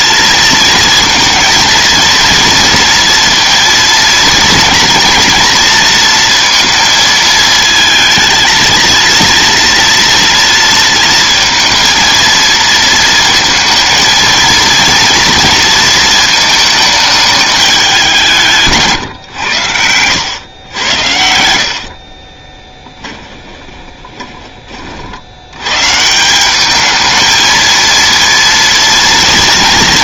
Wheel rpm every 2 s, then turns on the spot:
230, 230, 230, 230, 230, 230, 230, 230, 220, 140, 90, 10, 50, 210, 230.
20-24